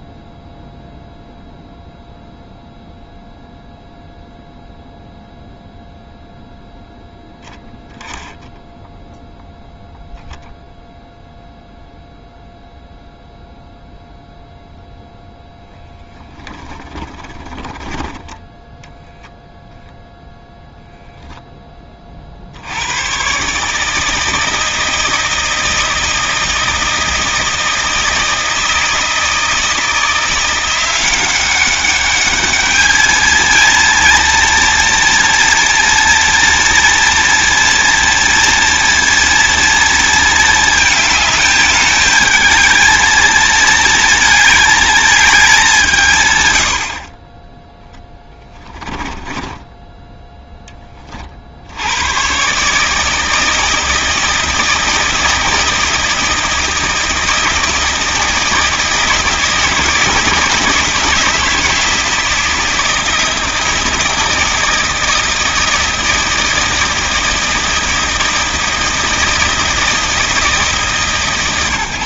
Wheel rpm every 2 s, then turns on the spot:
0, 0, 0, 10, 10, 0, 0, 0, 10, 10, 0, 80, 160, 160, 160, 170, 210, 230, 230, 230, 220, 220, 220, 90, 20, 10, 140, 160, 160, 160, 160, 160, 160, 160, 160, 160.
16-18 48-50